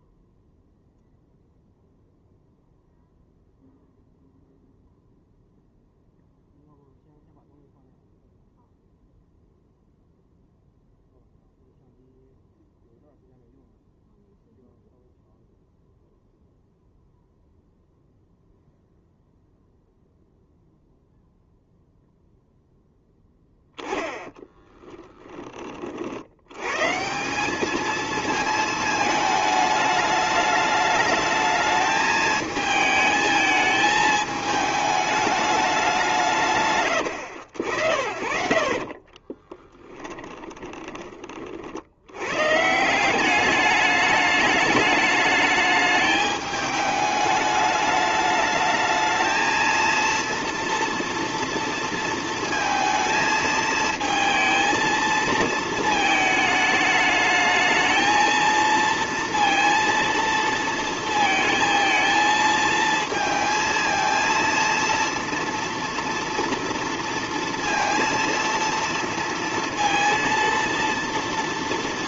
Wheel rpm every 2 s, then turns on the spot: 0, 0, 0, 0, 0, 0, 0, 0, 0, 0, 0, 0, 10, 120, 220, 210, 220, 210, 130, 40, 20, 150, 210, 210, 220, 230, 230, 220, 210, 230, 230, 230, 230, 230, 230, 230.
24-26 38-42